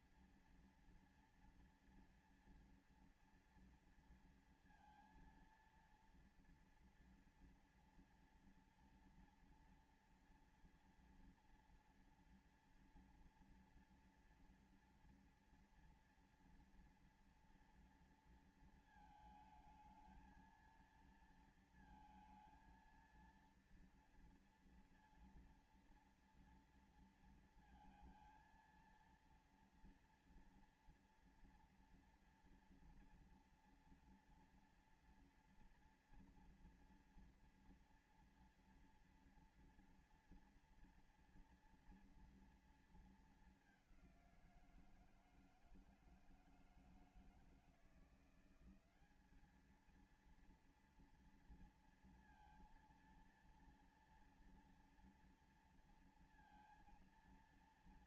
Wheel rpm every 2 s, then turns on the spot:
230, 230, 230, 230, 230, 240, 230, 230, 230, 230, 220, 230, 230, 230, 230, 230, 230, 230, 230, 240, 230, 230, 190, 160, 170, 230, 230, 240, 230.
none